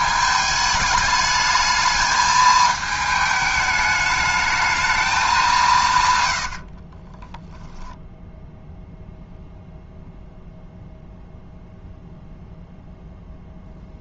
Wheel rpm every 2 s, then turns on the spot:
210, 220, 220, 40, 0, 0, 0.
6-8